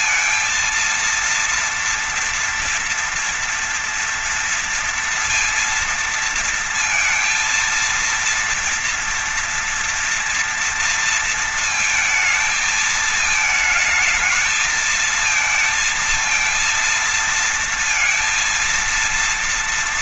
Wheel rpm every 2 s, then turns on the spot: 230, 230, 230, 230, 230, 230, 230, 220, 230, 230.
none